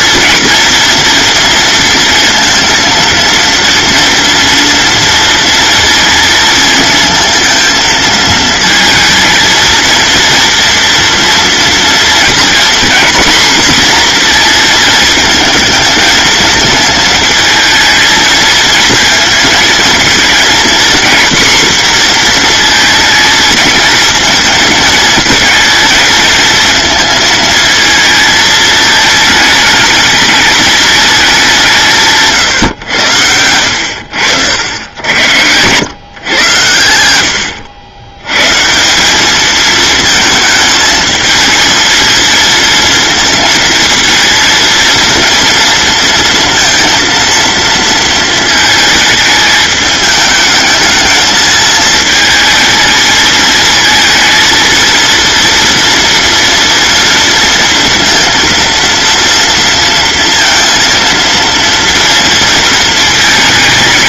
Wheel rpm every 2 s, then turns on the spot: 230, 230, 230, 230, 220, 230, 250, 230, 220, 230, 240, 230, 230, 230, 220, 210, 110, 80, 100, 170, 220, 230, 230, 230, 220, 220, 220, 230, 230, 230, 230, 230.
none